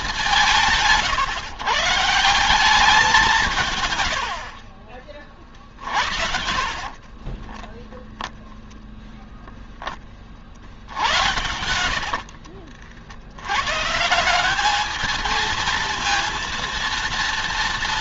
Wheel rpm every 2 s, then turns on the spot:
160, 180, 40, 40, 0, 70, 60, 210, 230.
4-8